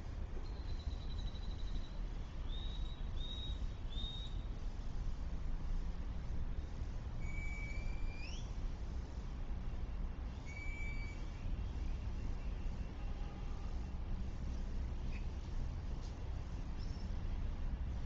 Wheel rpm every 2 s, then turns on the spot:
0, 0, 0, 0, 0, 0, 0, 0, 0.
none